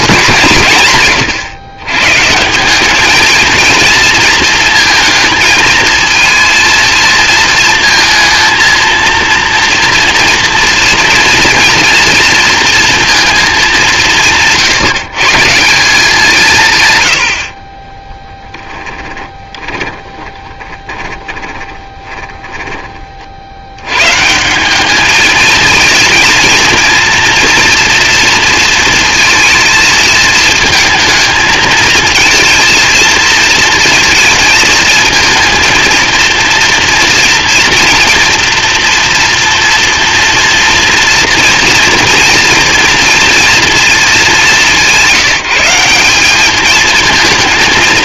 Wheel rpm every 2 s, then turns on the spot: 160, 190, 230, 230, 230, 240, 230, 140, 150, 30, 30, 20, 180, 230, 230, 220, 230, 230, 230, 230, 230, 230, 180, 210.
18-24